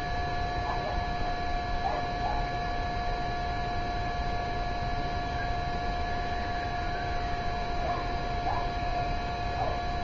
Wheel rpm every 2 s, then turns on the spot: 0, 0, 0, 0, 0.
none